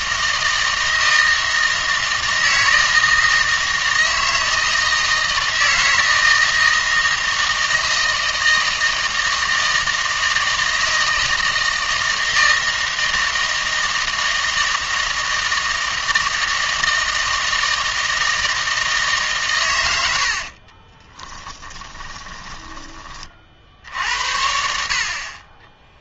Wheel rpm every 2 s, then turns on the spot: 160, 160, 160, 160, 160, 160, 160, 160, 160, 160, 40, 10, 60.
20-24